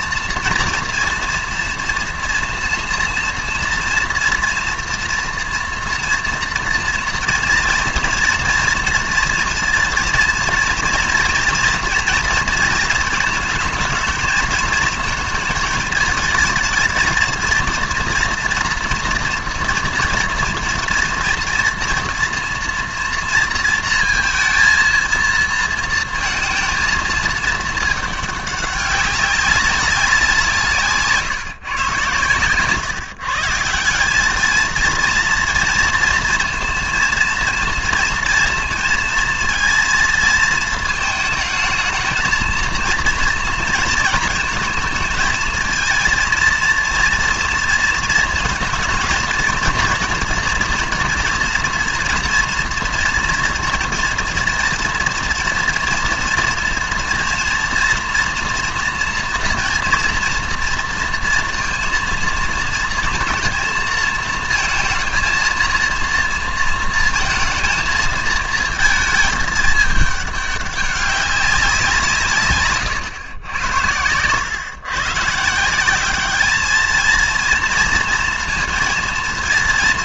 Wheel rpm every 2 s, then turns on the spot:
240, 230, 230, 230, 230, 230, 230, 220, 220, 240, 230, 230, 230, 230, 200, 170, 130, 220, 230, 230, 220, 230, 220, 230, 230, 230, 230, 230, 230, 230, 230, 230, 230, 230, 220, 200, 140, 120, 210, 230.
none